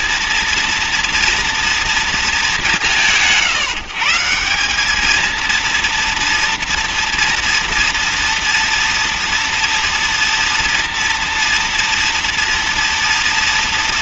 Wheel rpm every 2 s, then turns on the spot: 240, 170, 190, 230, 230, 230, 230.
none